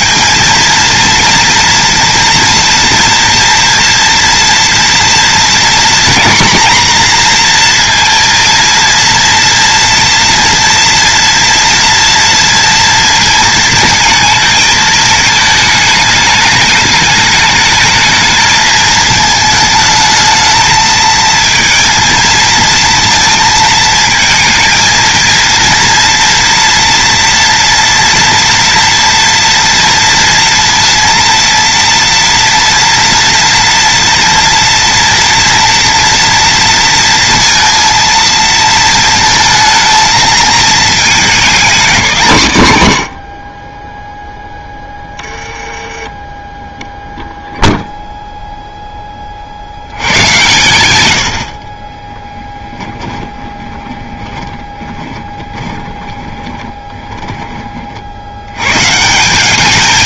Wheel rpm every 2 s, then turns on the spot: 230, 230, 230, 240, 230, 240, 230, 220, 210, 220, 220, 230, 230, 230, 230, 230, 230, 230, 230, 230, 230, 130, 10, 0, 10, 110, 10, 20, 10, 140.
52-58